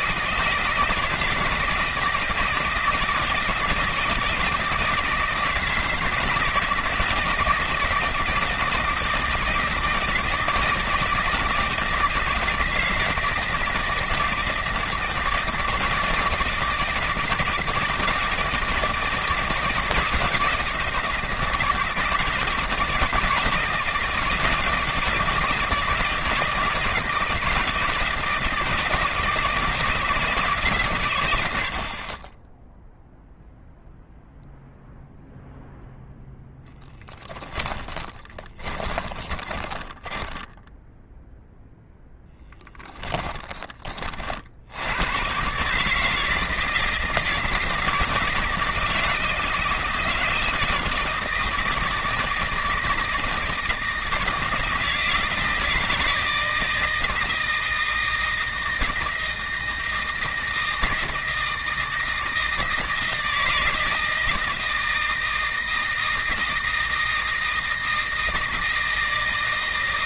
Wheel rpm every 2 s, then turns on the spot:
160, 160, 160, 160, 160, 160, 160, 160, 170, 160, 170, 160, 170, 150, 160, 120, 0, 0, 10, 20, 0, 10, 100, 170, 160, 160, 160, 160, 160, 160, 160, 160, 160, 160, 160.
36-40